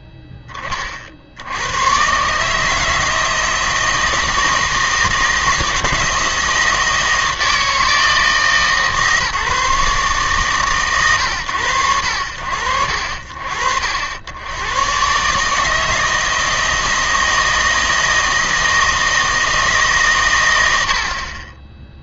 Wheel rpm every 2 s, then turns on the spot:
10, 150, 160, 160, 150, 130, 50, 110, 160, 160, 100.
none